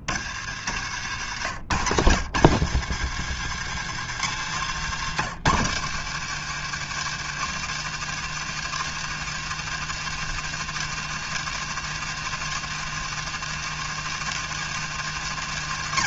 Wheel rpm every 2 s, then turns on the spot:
100, 130, 140, 160, 160, 160, 160, 140.
none